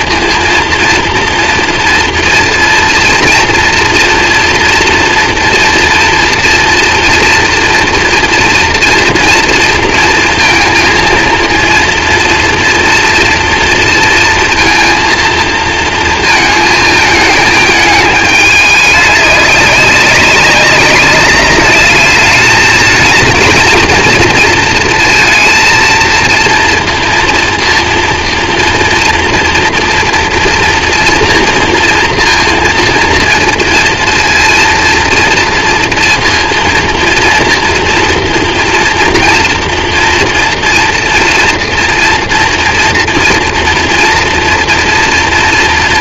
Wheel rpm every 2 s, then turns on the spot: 230, 230, 230, 230, 230, 230, 230, 230, 220, 210, 200, 220, 230, 230, 230, 230, 230, 230, 230, 230, 230, 230, 240.
none